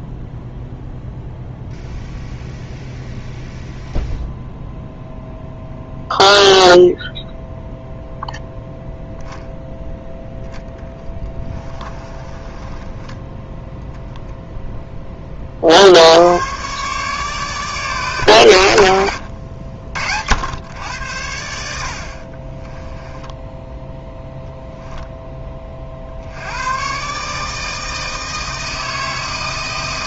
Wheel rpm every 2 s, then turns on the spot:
0, 0, 0, 0, 0, 10, 20, 10, 130, 90, 100, 20, 0, 110, 160.
10-14 22-24